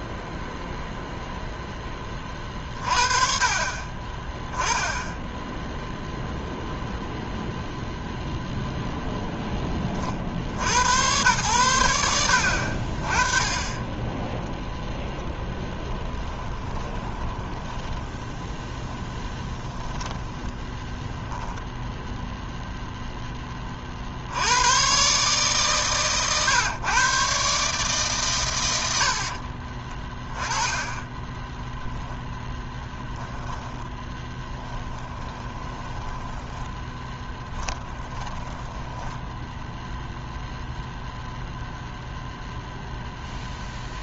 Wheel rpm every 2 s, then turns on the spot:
0, 30, 10, 0, 0, 90, 40, 0, 20, 10, 10, 0, 130, 130, 70, 20, 10, 10, 10, 10, 0, 0.
16-20 30-40